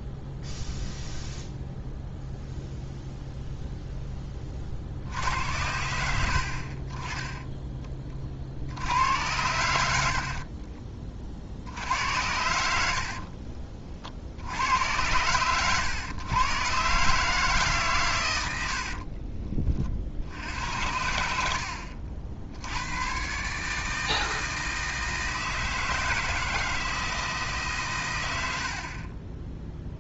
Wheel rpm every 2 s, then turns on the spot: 0, 0, 30, 60, 70, 40, 70, 80, 120, 90, 80, 80, 160, 160, 70.
none